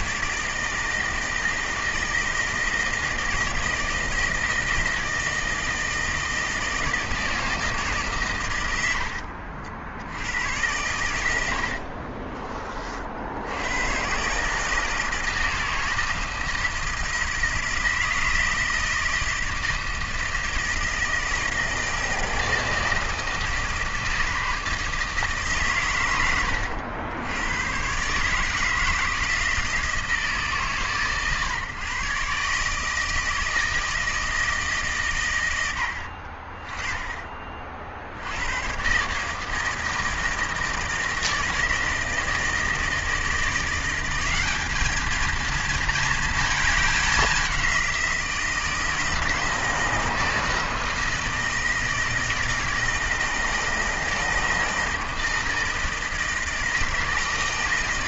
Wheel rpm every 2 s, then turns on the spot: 160, 160, 160, 160, 100, 110, 30, 150, 160, 160, 160, 160, 160, 90, 160, 140, 140, 150, 40, 110, 160, 160, 200, 210, 170, 160, 160, 160, 160.
none